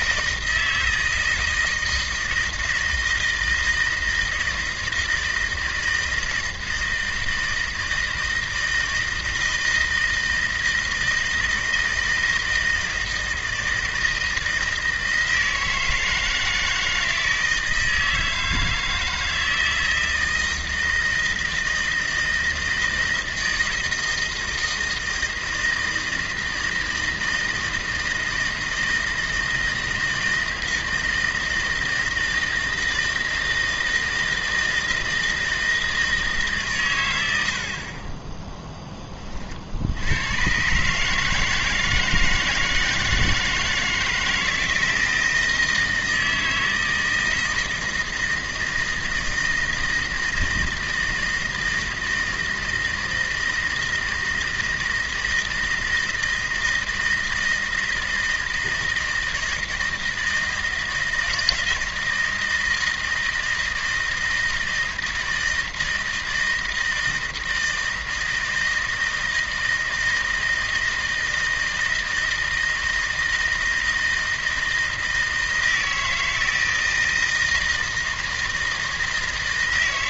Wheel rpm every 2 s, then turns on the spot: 160, 160, 160, 160, 160, 160, 160, 160, 160, 160, 160, 160, 160, 160, 160, 160, 160, 160, 120, 10, 140, 160, 160, 160, 160, 160, 160, 160, 160, 160, 160, 160, 160, 160, 160, 160, 160, 160, 160, 160.
none